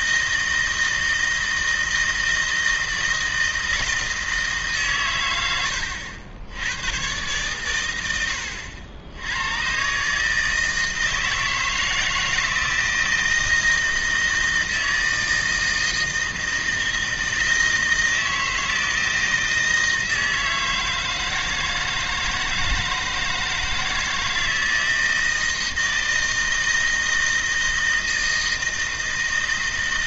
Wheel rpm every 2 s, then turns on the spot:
160, 160, 140, 100, 70, 160, 160, 160, 160, 160, 160, 160, 160, 160, 160.
none